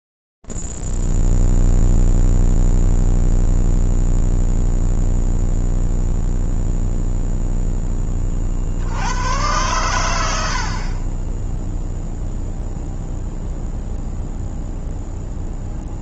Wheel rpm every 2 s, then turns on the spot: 0, 0, 0, 0, 20, 100, 0, 0.
none